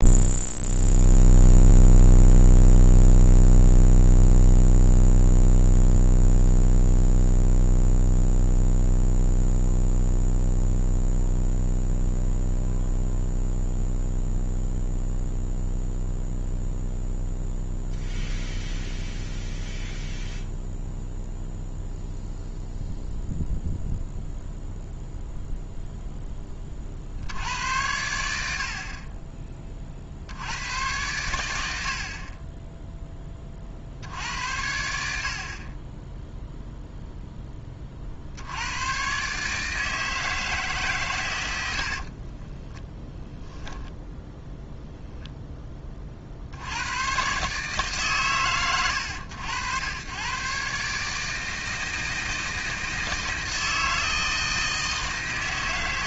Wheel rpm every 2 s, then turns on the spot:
0, 0, 0, 0, 0, 0, 0, 0, 0, 0, 0, 0, 0, 40, 60, 100, 10, 70, 0, 100, 150, 10, 0, 90, 110, 140, 160, 160.
42-44